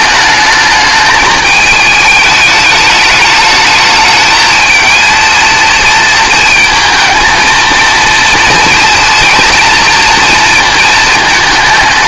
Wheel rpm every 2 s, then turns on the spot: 210, 210, 230, 220, 230, 220.
none